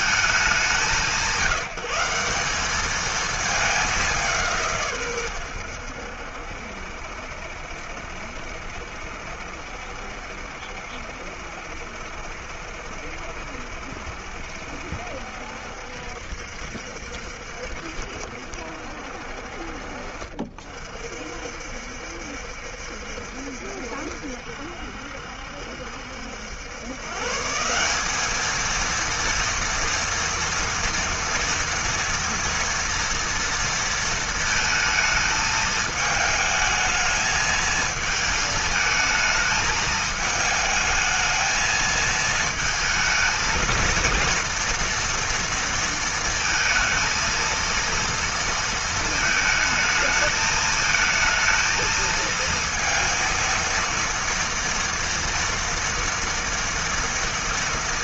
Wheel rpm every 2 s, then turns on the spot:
180, 190, 80, 70, 70, 70, 70, 70, 70, 50, 60, 70, 70, 160, 230, 230, 230, 220, 220, 220, 220, 230, 230, 230, 220, 220, 230, 230, 230.
none